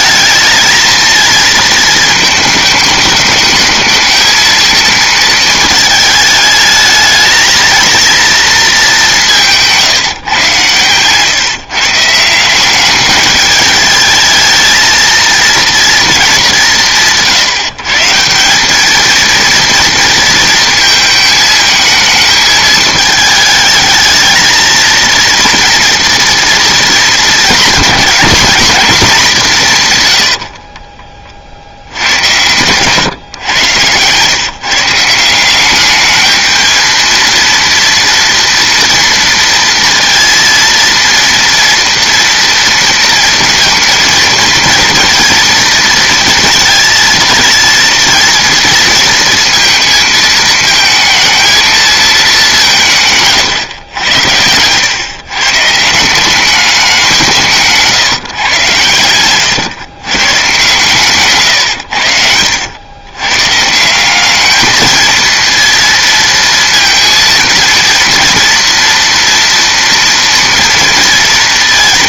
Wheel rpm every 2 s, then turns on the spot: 220, 210, 230, 220, 220, 120, 190, 220, 190, 200, 230, 220, 230, 230, 220, 40, 120, 140, 220, 230, 230, 230, 230, 230, 230, 220, 180, 110, 190, 130, 140, 100, 210, 230, 230, 230.
30-32